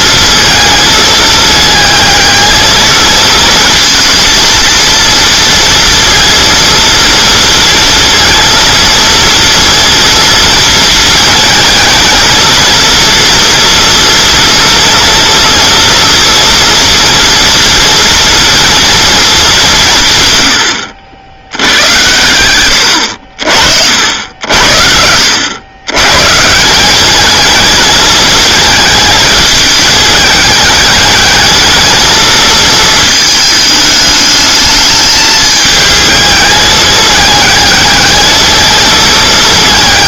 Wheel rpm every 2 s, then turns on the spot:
220, 220, 230, 230, 230, 220, 230, 230, 230, 230, 90, 90, 70, 170, 220, 210, 220, 210, 210, 220.
none